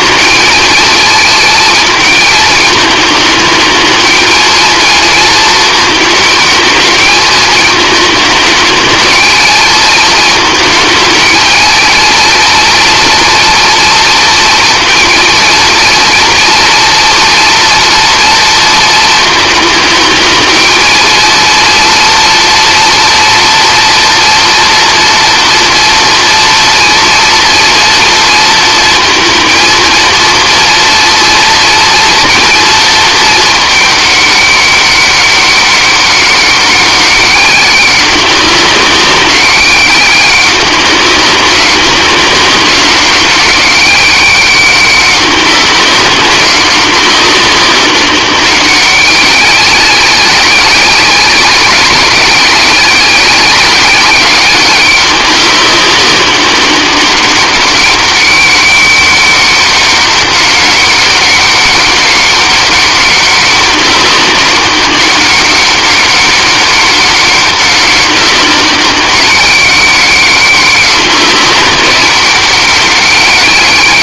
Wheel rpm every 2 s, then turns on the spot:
230, 220, 230, 220, 210, 220, 230, 230, 230, 230, 230, 230, 230, 230, 230, 230, 220, 200, 190, 190, 200, 200, 200, 190, 200, 190, 190, 190, 200, 200, 200, 200, 200, 190, 190, 190, 200.
none